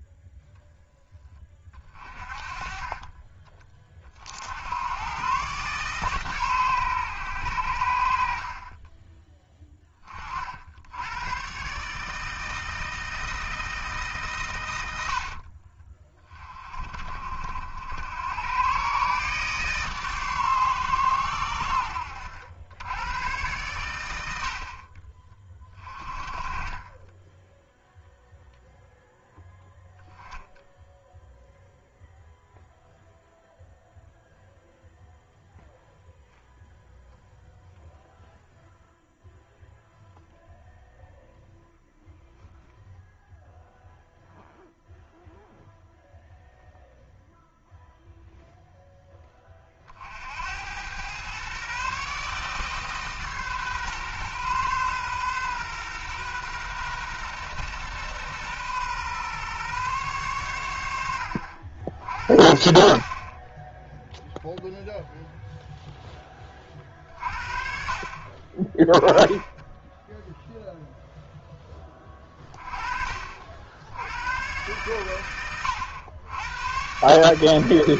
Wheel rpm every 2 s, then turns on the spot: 0, 30, 90, 120, 30, 80, 160, 100, 30, 120, 130, 90, 50, 20, 0, 0, 0, 0, 0, 0, 0, 0, 0, 0, 0, 90, 150, 130, 120, 120, 90, 50, 0, 40, 30, 0, 30, 110, 110.
none